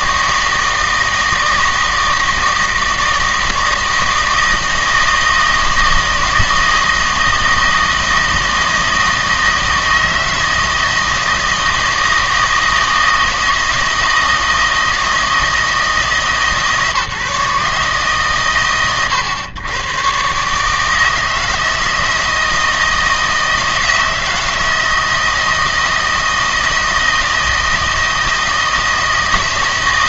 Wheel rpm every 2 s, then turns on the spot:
160, 160, 160, 160, 160, 160, 160, 160, 150, 120, 150, 160, 160, 160, 160.
none